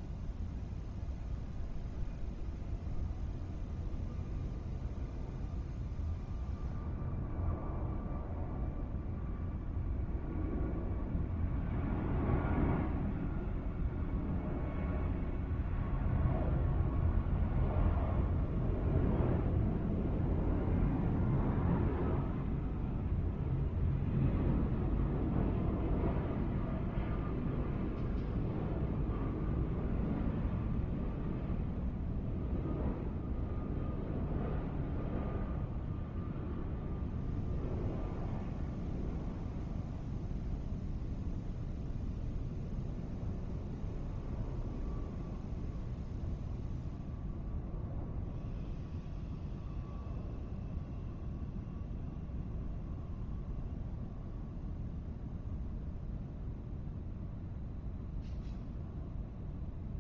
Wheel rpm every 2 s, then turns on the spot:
0, 0, 0, 0, 0, 0, 0, 0, 0, 0, 0, 0, 0, 0, 0, 0, 0, 0, 0, 0, 0, 0, 0, 0, 0, 0, 0, 0, 0, 0.
none